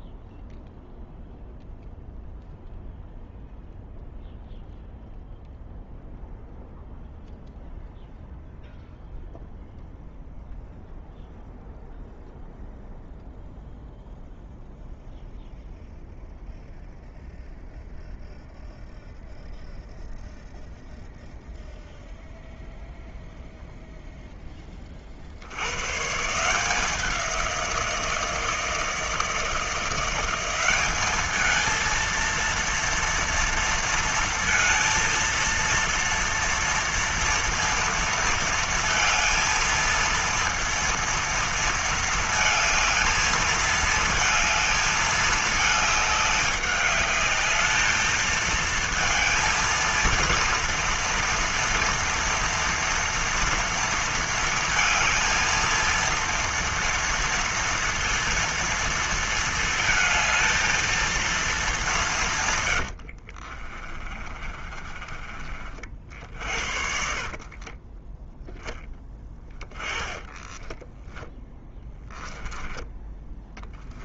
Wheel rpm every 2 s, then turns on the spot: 0, 0, 0, 0, 0, 0, 0, 0, 0, 0, 0, 0, 10, 160, 160, 190, 230, 230, 240, 230, 230, 220, 220, 210, 220, 230, 230, 230, 230, 230, 220, 110, 30, 50, 10, 10, 10.
62-68 70-72